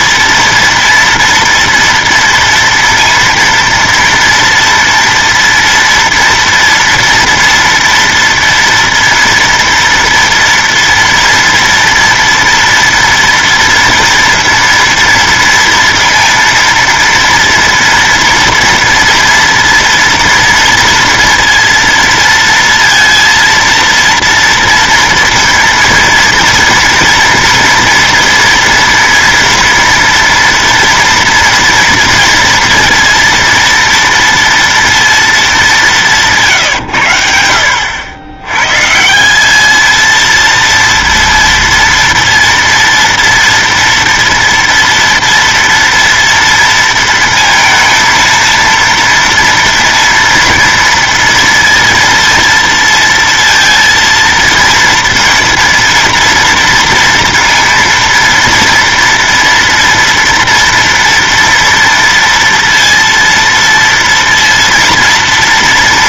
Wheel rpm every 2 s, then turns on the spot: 230, 230, 230, 230, 230, 230, 230, 230, 230, 230, 230, 230, 230, 230, 230, 230, 230, 230, 110, 140, 230, 230, 230, 230, 230, 230, 230, 230, 230, 230, 230, 230, 230.
none